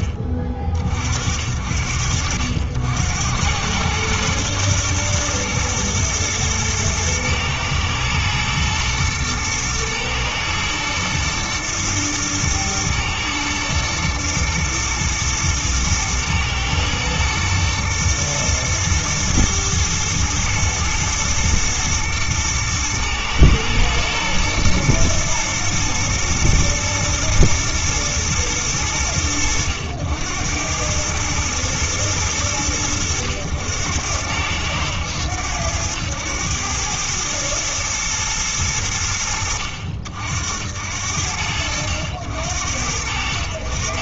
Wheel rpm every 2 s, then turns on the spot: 40, 80, 110, 110, 120, 110, 120, 110, 110, 110, 110, 120, 110, 110, 100, 100, 100, 100, 110, 90, 70, 80.
none